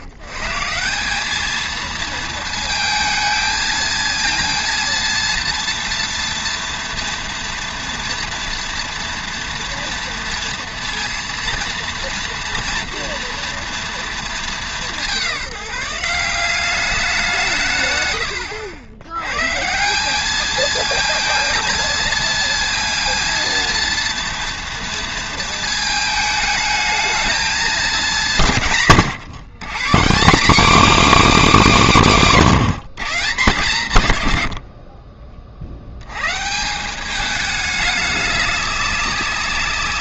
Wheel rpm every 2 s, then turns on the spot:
140, 220, 230, 230, 230, 230, 230, 210, 190, 90, 220, 230, 230, 220, 170, 270, 200, 70, 170, 200.
none